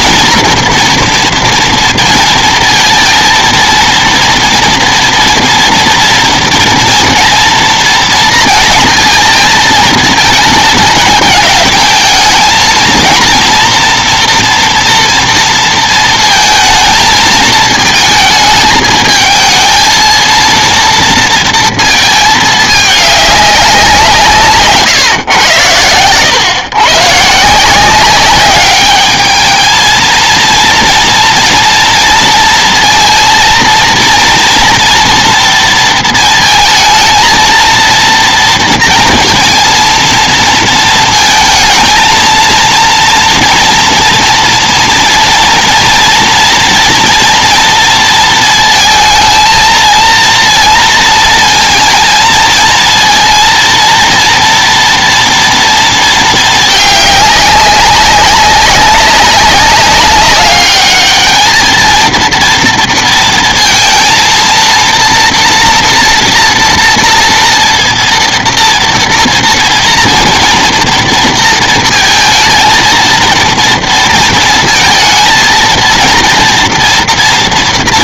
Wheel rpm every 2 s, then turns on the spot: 240, 230, 230, 230, 230, 220, 220, 230, 230, 220, 230, 210, 150, 130, 200, 230, 230, 230, 220, 230, 230, 230, 230, 230, 220, 230, 230, 240, 220, 200, 200, 230, 230, 230, 230, 230, 220, 230, 240.
none